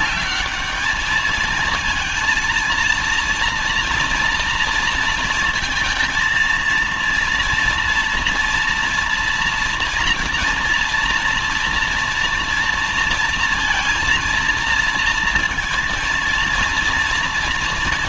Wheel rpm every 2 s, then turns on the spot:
200, 230, 230, 230, 230, 230, 230, 230, 230.
none